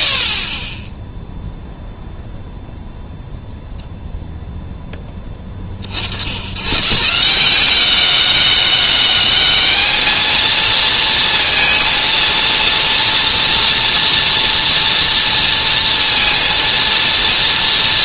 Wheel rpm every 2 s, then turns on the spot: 30, 0, 0, 110, 200, 220, 230, 230, 230.
none